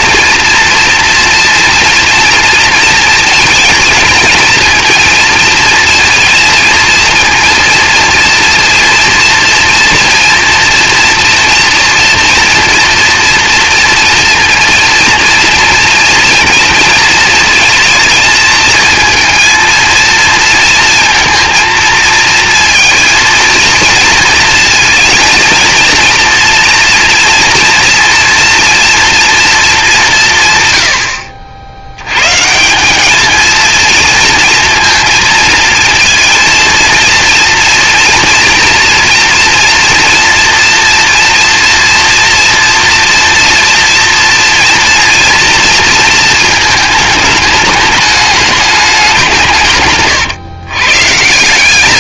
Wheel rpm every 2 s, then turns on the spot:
230, 230, 230, 230, 230, 230, 230, 230, 230, 220, 230, 230, 230, 230, 230, 120, 190, 230, 230, 230, 230, 240, 230, 220, 200, 120.
none